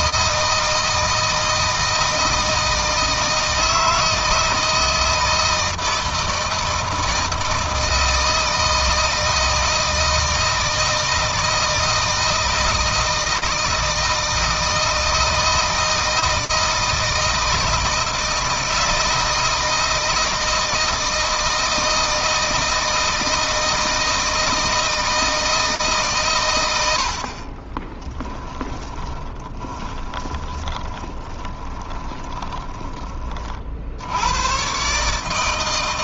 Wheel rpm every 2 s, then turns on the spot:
160, 160, 160, 160, 160, 160, 160, 160, 160, 160, 160, 160, 160, 90, 10, 20, 20, 130.
28-32